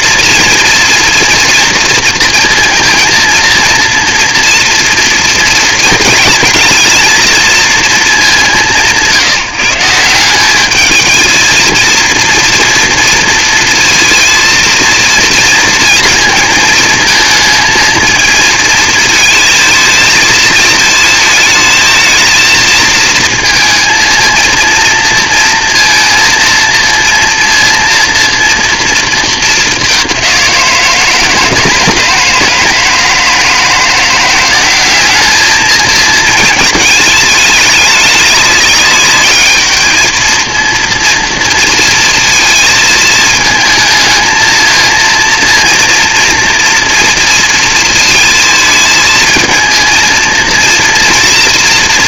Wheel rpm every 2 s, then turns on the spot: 230, 230, 230, 220, 190, 200, 230, 230, 220, 220, 220, 230, 230, 230, 230, 180, 160, 190, 220, 200, 220, 230, 220, 230, 220, 230.
none